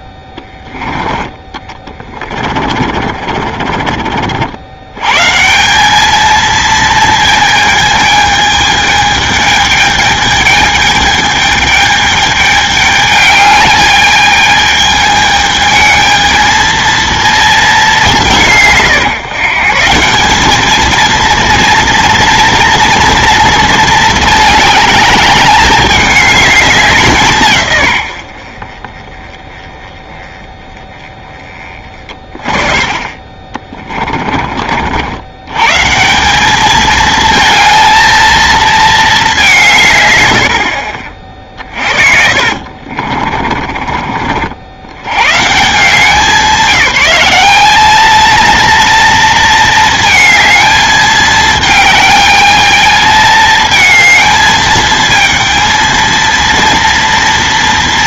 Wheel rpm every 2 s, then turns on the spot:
10, 50, 80, 220, 220, 210, 210, 210, 220, 140, 210, 230, 220, 200, 50, 20, 20, 40, 200, 230, 70, 40, 70, 200, 230, 220, 210, 220, 230.
0-4 42-44